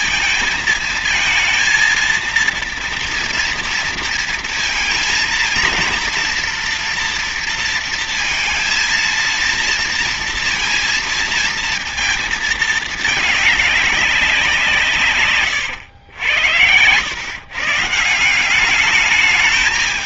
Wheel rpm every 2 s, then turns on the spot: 230, 230, 230, 230, 230, 230, 220, 170, 100, 180.
none